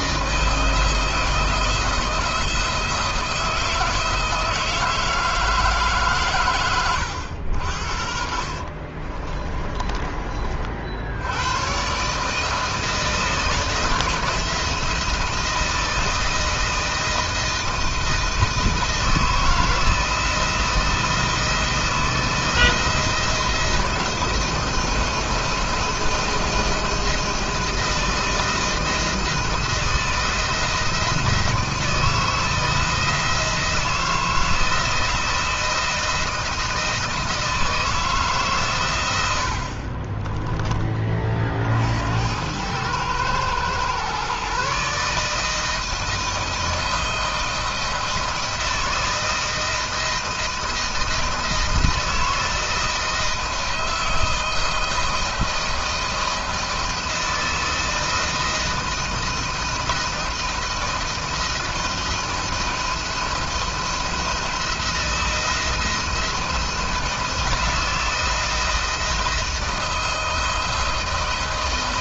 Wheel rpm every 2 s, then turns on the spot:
170, 170, 160, 120, 50, 70, 160, 170, 160, 160, 160, 160, 160, 160, 160, 160, 160, 170, 170, 110, 30, 100, 150, 160, 160, 160, 170, 160, 160, 160, 160, 170, 170, 170, 170, 160.
8-10